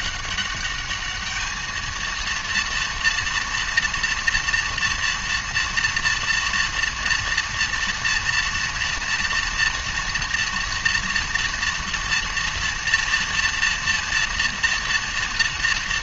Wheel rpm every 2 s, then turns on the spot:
210, 230, 230, 230, 230, 230, 230, 230.
none